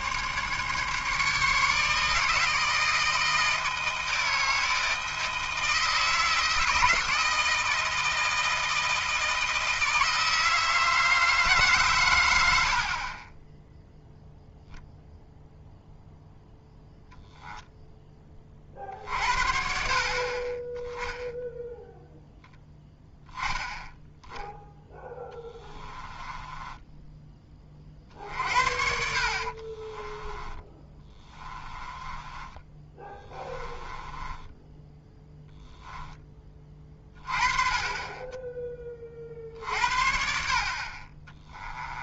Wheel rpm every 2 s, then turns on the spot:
150, 160, 160, 160, 160, 160, 70, 0, 0, 40, 20, 0, 0, 10, 60, 20, 20, 10, 20, 20, 50.
26-36